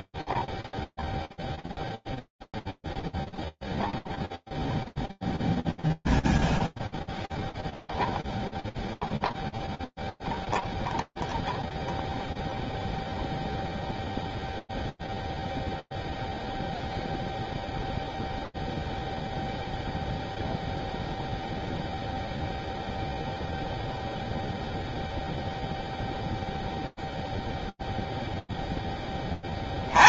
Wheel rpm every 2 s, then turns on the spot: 0, 0, 0, 0, 0, 0, 0, 0, 0, 0, 0, 0, 0, 140, 100.
none